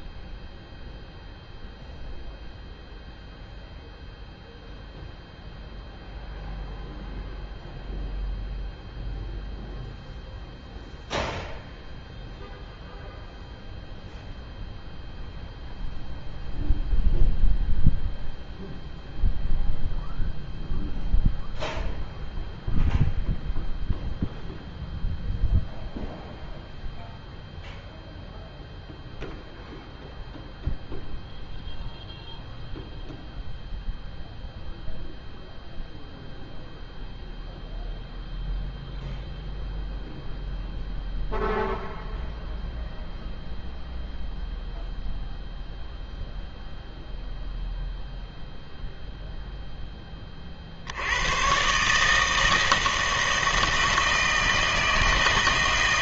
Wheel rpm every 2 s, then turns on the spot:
0, 0, 0, 0, 0, 0, 0, 0, 0, 0, 0, 0, 0, 0, 0, 0, 0, 0, 0, 0, 0, 0, 0, 0, 0, 50, 160, 160.
none